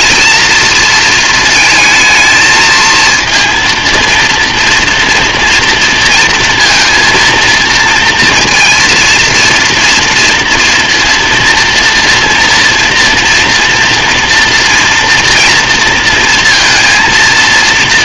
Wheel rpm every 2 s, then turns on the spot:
220, 220, 230, 230, 230, 230, 240, 230, 230.
none